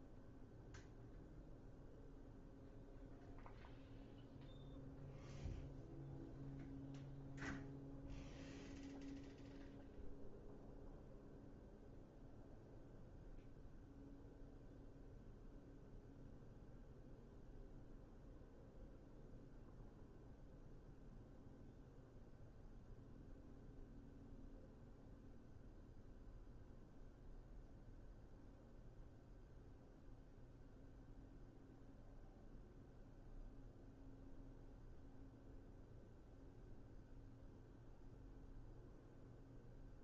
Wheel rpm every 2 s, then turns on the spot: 0, 0, 0, 0, 0, 0, 0, 0, 0, 0, 0, 0, 0, 0, 0, 0, 0, 0, 0, 0.
none